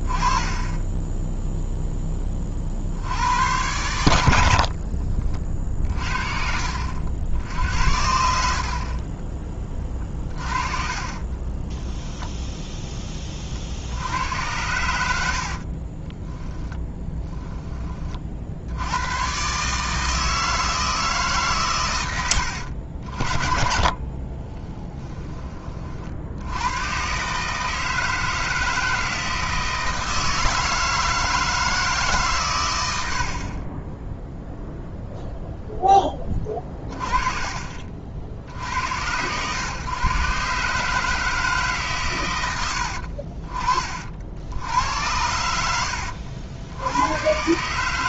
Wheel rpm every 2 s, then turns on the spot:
10, 70, 50, 70, 40, 30, 30, 80, 10, 90, 160, 70, 10, 130, 160, 160, 90, 0, 20, 100, 150, 70, 90, 100.
4-6 8-12 16-18